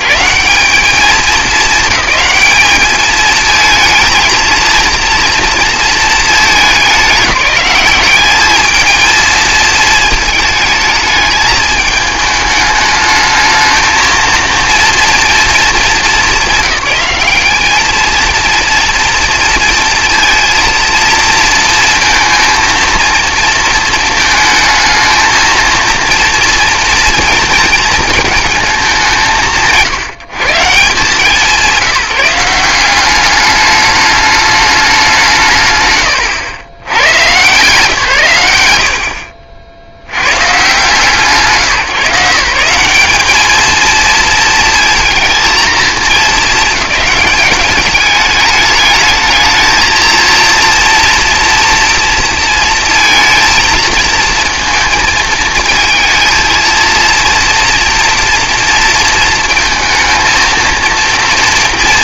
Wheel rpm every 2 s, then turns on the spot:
180, 220, 230, 210, 220, 220, 210, 230, 190, 230, 230, 230, 220, 230, 190, 160, 190, 200, 90, 80, 90, 170, 230, 210, 210, 230, 230, 230, 230, 230, 230.
38-40